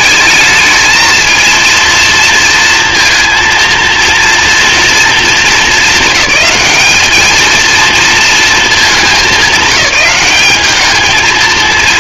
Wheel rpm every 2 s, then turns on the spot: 220, 230, 230, 210, 200, 210.
none